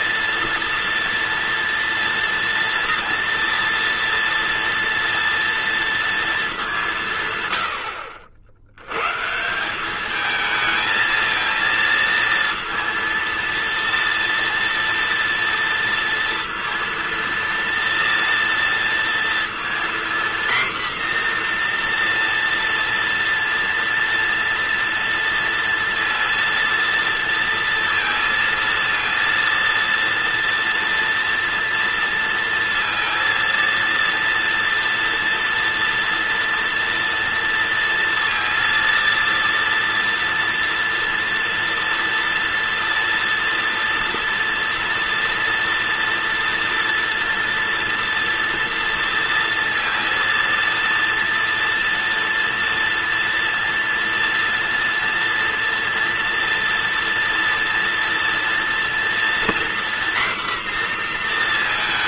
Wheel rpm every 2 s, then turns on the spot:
230, 230, 230, 180, 110, 220, 230, 230, 230, 230, 240, 230, 230, 230, 230, 230, 230, 230, 230, 230, 230, 230, 240, 240, 230, 230, 230, 230, 230, 230, 240.
none